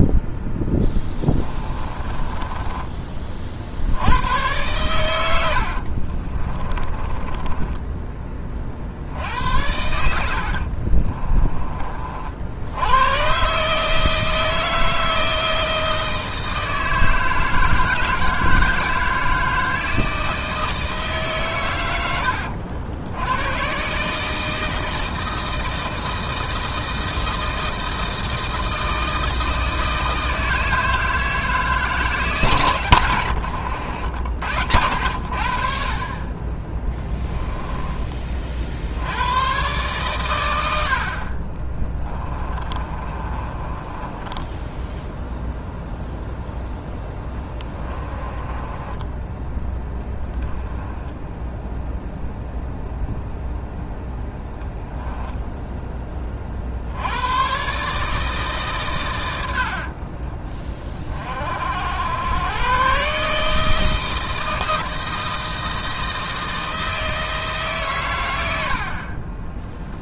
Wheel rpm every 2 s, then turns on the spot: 10, 20, 110, 30, 70, 40, 100, 160, 160, 160, 160, 80, 160, 160, 160, 160, 110, 80, 10, 80, 70, 30, 0, 0, 10, 10, 0, 0, 80, 130, 40, 130, 160, 160, 60.
0-2 6-8 10-12 36-38 42-44 48-50